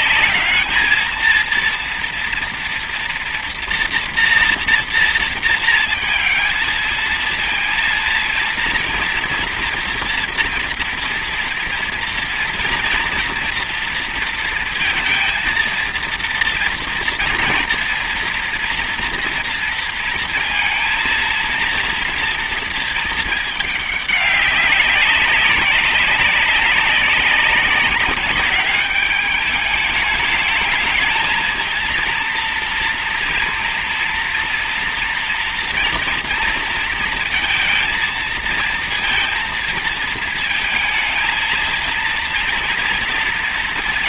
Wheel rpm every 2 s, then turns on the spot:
220, 230, 230, 230, 230, 230, 230, 230, 230, 230, 230, 220, 200, 190, 200, 220, 230, 230, 230, 230, 230, 210.
none